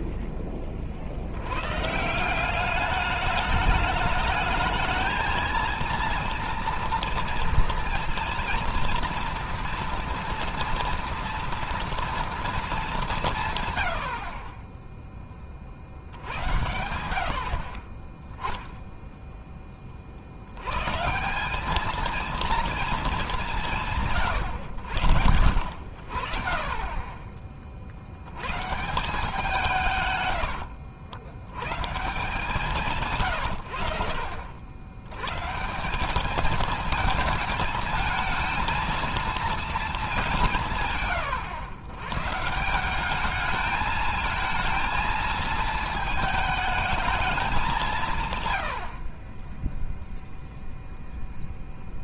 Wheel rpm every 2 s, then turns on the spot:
30, 200, 220, 230, 230, 230, 220, 30, 80, 0, 110, 230, 90, 30, 130, 100, 150, 80, 220, 230, 170, 170, 230, 220, 90, 0.
30-32